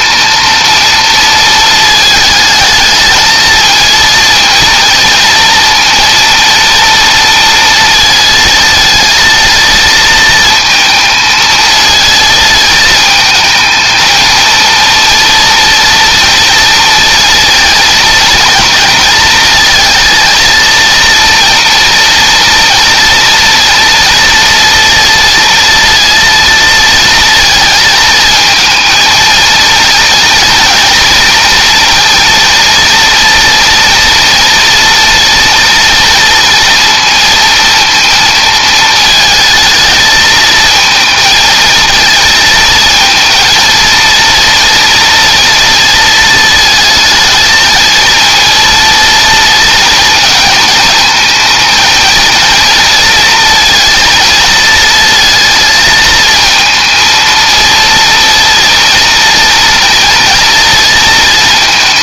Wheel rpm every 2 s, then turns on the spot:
230, 220, 230, 230, 230, 220, 220, 230, 230, 220, 230, 230, 230, 230, 220, 240, 230, 240, 230, 220, 220, 230, 230, 220, 230, 230, 230, 230, 230, 230, 230.
none